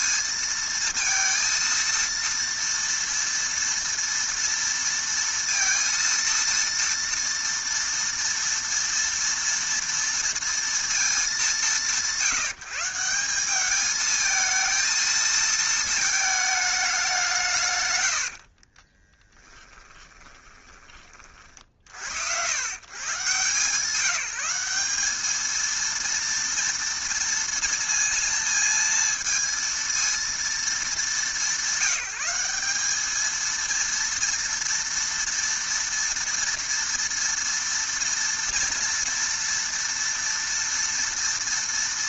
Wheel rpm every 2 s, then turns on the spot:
230, 230, 230, 230, 230, 230, 160, 220, 210, 40, 20, 120, 180, 230, 230, 220, 200, 230, 230, 230, 230.
18-22